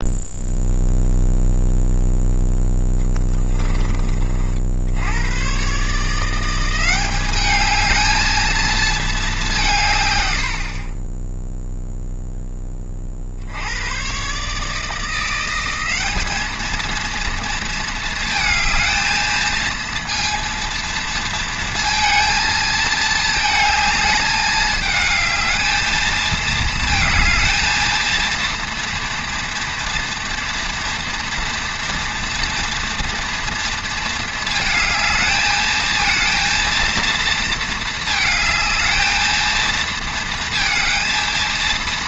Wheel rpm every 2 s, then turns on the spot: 0, 10, 70, 180, 220, 60, 10, 150, 220, 220, 230, 230, 210, 220, 230, 230, 230, 220, 230, 220, 220.
2-4